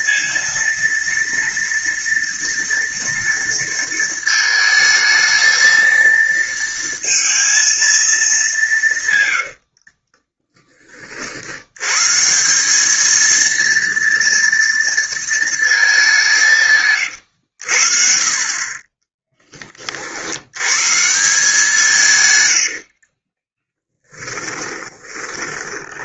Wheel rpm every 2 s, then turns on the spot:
230, 230, 220, 230, 160, 40, 210, 230, 140, 20, 140, 60, 30.
8-10 16-18 22-26